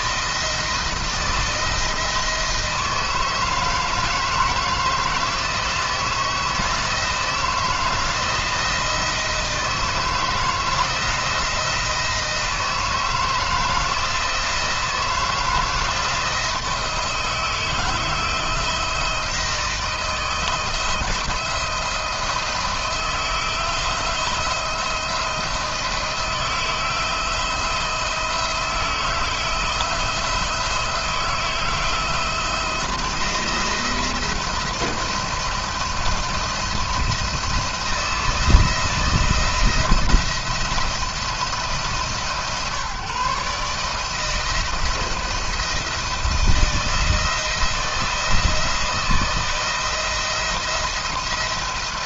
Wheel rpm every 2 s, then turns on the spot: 170, 160, 160, 170, 170, 160, 160, 170, 160, 160, 160, 160, 170, 170, 160, 160, 170, 170, 170, 170, 160, 150, 170, 170, 170, 160.
none